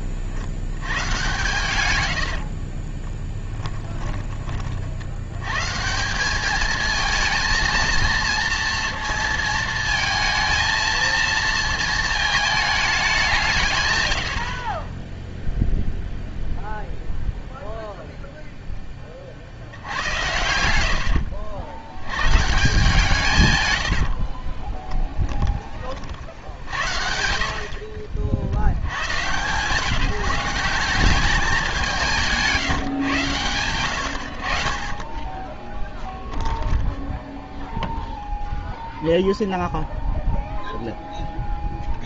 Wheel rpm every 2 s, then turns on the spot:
80, 40, 30, 210, 230, 230, 220, 50, 0, 0, 80, 150, 20, 70, 70, 170, 160, 50, 10, 0, 0.
2-4 20-22 24-26 36-38